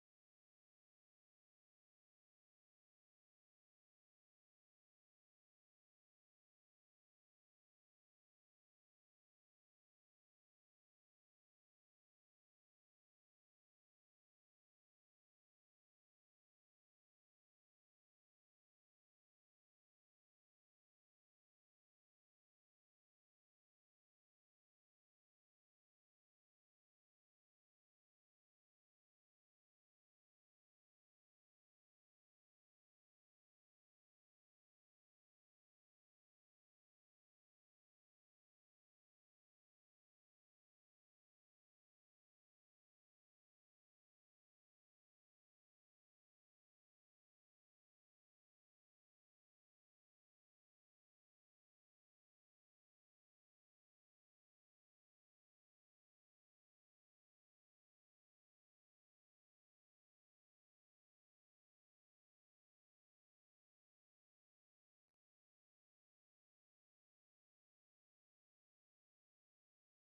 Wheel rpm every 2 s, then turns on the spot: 0, 0, 0, 0, 0, 0, 0, 0, 0, 0, 0, 0, 0, 0, 0, 0, 0, 0, 0, 0, 0, 0, 0, 0, 0, 0, 0, 0, 0, 0, 0, 0, 0, 0, 0.
none